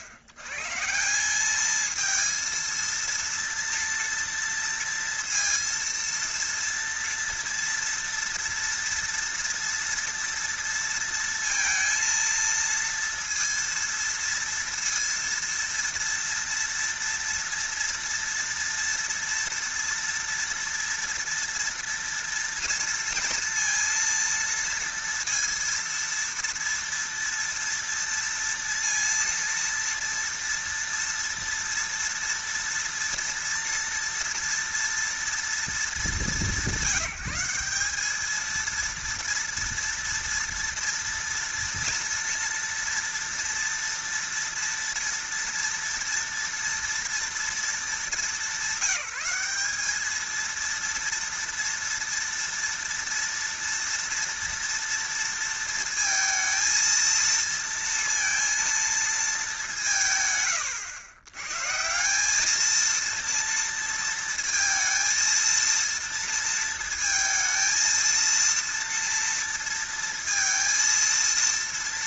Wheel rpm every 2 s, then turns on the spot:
100, 230, 230, 230, 230, 230, 230, 230, 230, 230, 230, 230, 230, 230, 230, 230, 230, 230, 180, 230, 230, 230, 230, 230, 200, 230, 230, 230, 230, 230, 80, 220, 230, 230, 230, 230.
none